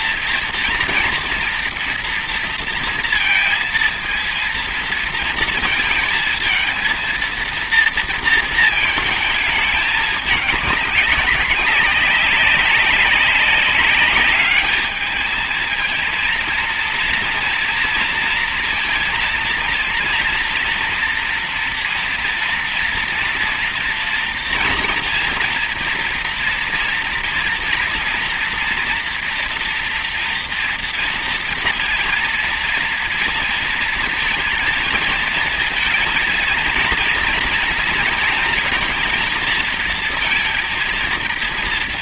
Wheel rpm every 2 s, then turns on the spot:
230, 230, 230, 230, 220, 210, 190, 210, 230, 230, 230, 230, 230, 230, 240, 230, 230, 220, 230, 230, 230.
none